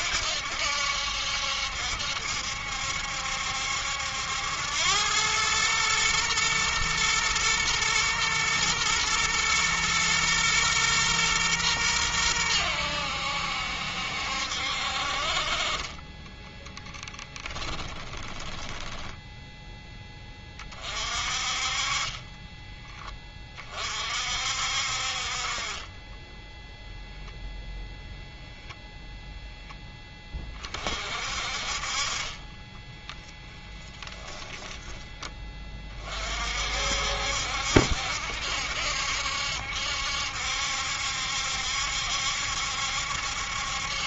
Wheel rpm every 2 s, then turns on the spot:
70, 70, 90, 120, 120, 120, 90, 60, 10, 10, 30, 20, 50, 0, 0, 40, 10, 10, 60, 70, 70, 70.
16-20 32-36